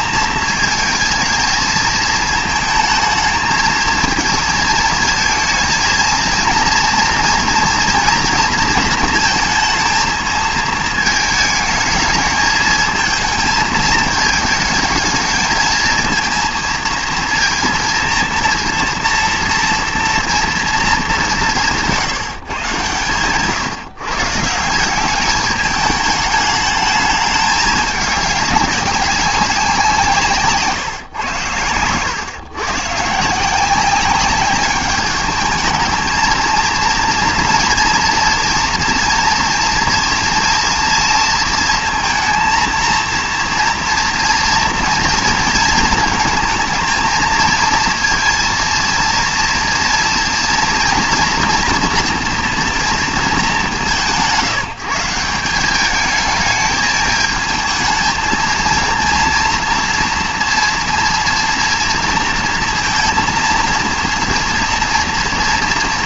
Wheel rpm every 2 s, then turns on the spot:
220, 220, 220, 230, 230, 220, 220, 220, 230, 230, 210, 130, 190, 210, 200, 140, 130, 210, 230, 230, 230, 230, 230, 230, 230, 230, 230, 170, 220, 230, 240, 230, 230.
none